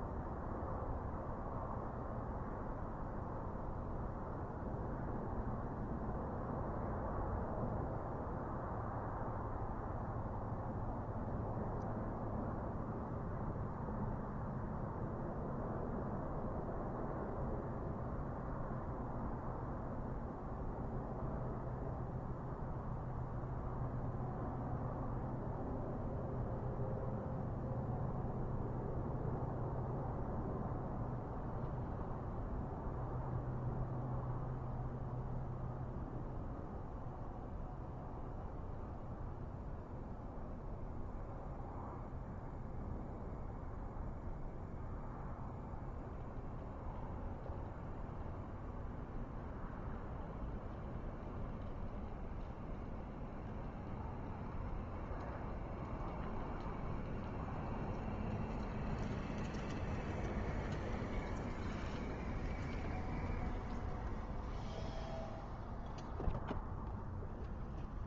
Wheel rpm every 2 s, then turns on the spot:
0, 0, 0, 0, 0, 0, 0, 0, 0, 0, 0, 0, 0, 0, 0, 0, 0, 0, 0, 0, 0, 0, 0, 0, 0, 0, 0, 0, 0, 0, 0, 0, 0, 0.
none